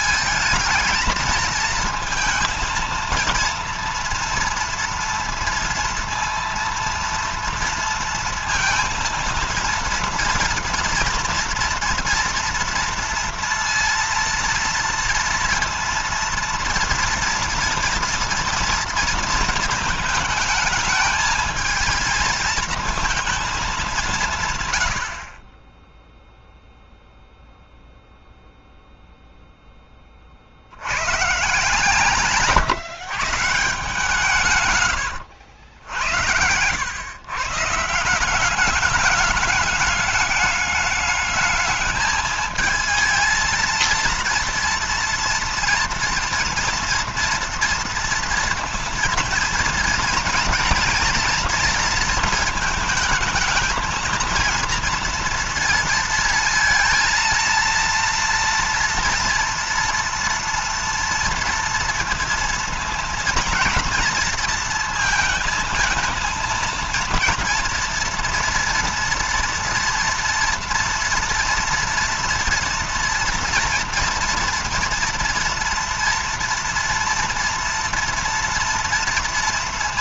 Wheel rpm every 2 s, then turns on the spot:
220, 230, 230, 230, 230, 230, 230, 230, 230, 230, 220, 230, 90, 0, 0, 100, 140, 120, 100, 210, 210, 220, 230, 230, 230, 240, 220, 230, 230, 230, 230, 230, 230, 230, 230, 230, 230, 230, 230, 230.
34-36